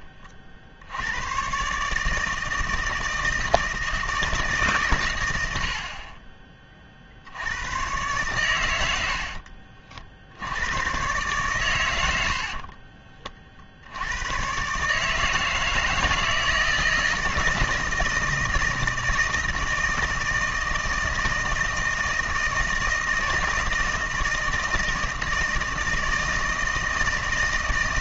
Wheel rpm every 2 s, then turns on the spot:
60, 160, 140, 30, 80, 110, 40, 130, 160, 160, 160, 160, 160, 160.
12-14